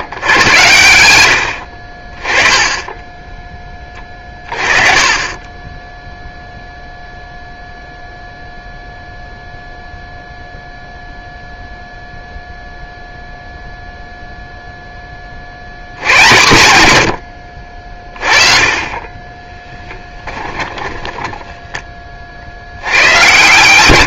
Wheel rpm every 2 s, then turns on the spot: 80, 20, 20, 0, 0, 0, 0, 10, 120, 30, 10, 100.
20-22